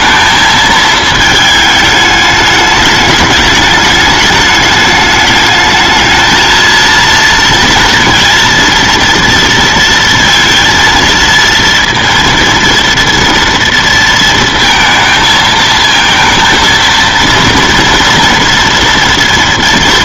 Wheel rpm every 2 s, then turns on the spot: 220, 210, 210, 230, 230, 230, 230, 230, 230, 230.
none